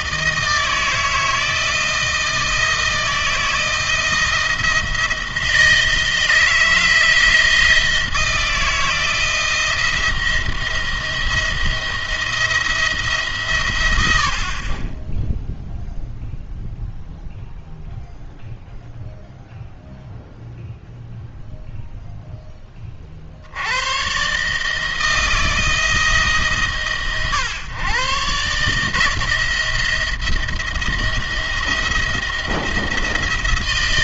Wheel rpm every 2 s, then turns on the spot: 160, 160, 170, 160, 170, 170, 160, 40, 0, 0, 0, 20, 150, 140, 140, 170, 170.
none